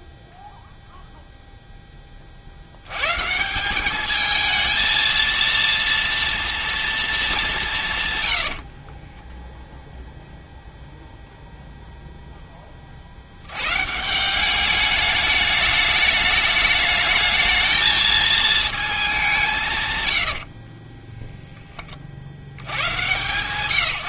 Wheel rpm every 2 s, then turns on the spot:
0, 90, 220, 230, 40, 0, 30, 200, 210, 210, 20, 110.
8-10 20-22